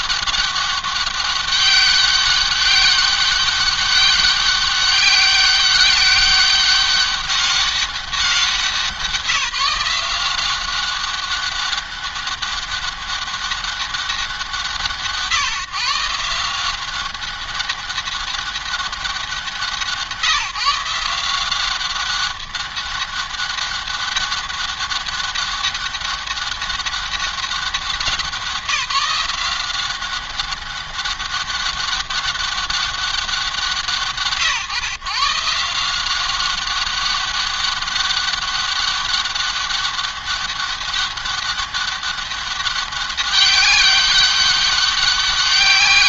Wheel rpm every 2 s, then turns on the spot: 200, 200, 200, 190, 180, 180, 200, 180, 180, 190, 160, 200, 200, 200, 180, 200, 200, 140, 190, 200, 200, 200, 200.
none